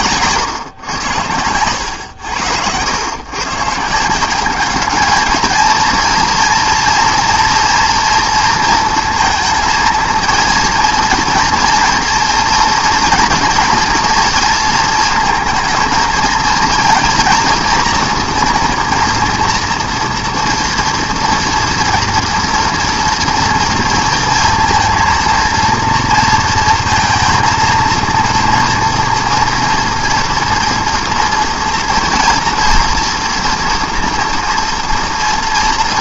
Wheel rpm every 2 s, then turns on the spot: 100, 140, 220, 230, 220, 230, 240, 230, 230, 230, 230, 230, 230, 230, 240, 230, 230, 230.
0-2